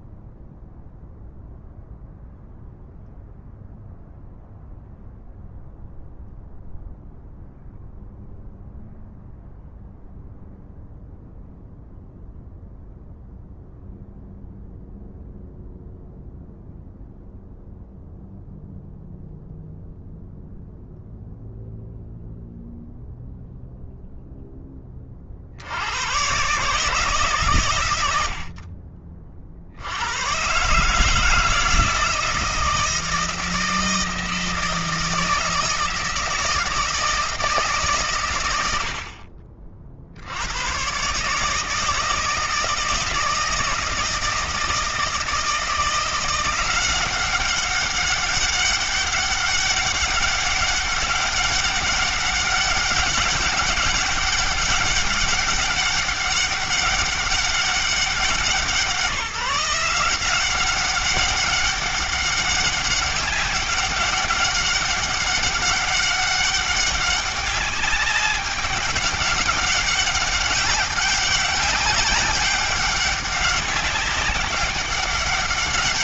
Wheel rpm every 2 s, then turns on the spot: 0, 0, 0, 0, 0, 0, 0, 0, 0, 0, 0, 0, 30, 150, 40, 160, 160, 160, 160, 70, 120, 160, 160, 180, 190, 190, 200, 190, 200, 170, 190, 200, 200, 200, 190, 200, 200, 200.
none